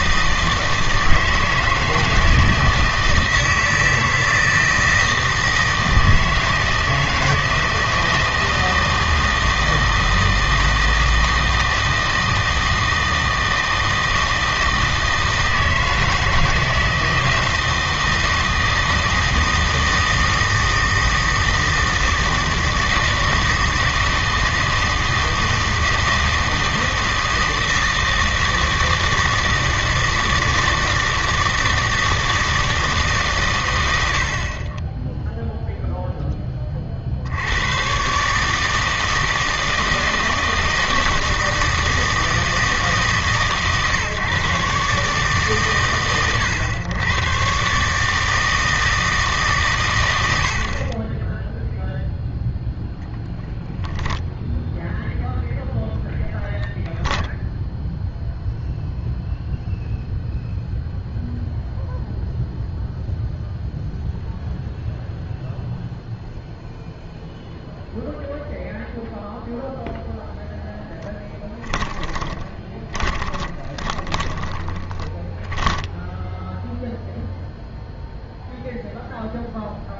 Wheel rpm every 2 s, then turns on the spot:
160, 160, 160, 160, 160, 160, 160, 160, 160, 160, 160, 160, 160, 160, 160, 160, 160, 30, 30, 150, 160, 160, 140, 120, 160, 70, 0, 0, 10, 0, 0, 0, 0, 0, 0, 0, 20, 20, 0, 0.
56-58 72-76